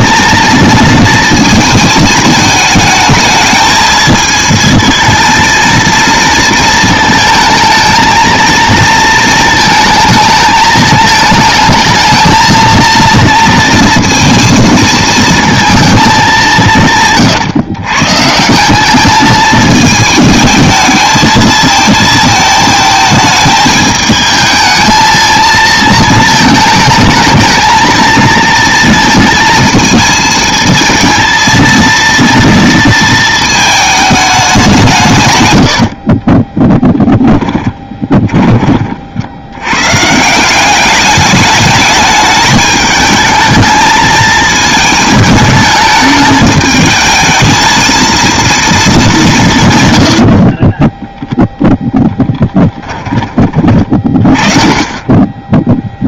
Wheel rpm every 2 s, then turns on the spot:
230, 220, 220, 230, 230, 220, 230, 230, 170, 190, 220, 220, 220, 220, 230, 230, 230, 180, 20, 30, 190, 210, 220, 220, 220, 20, 20, 30.
36-38 50-54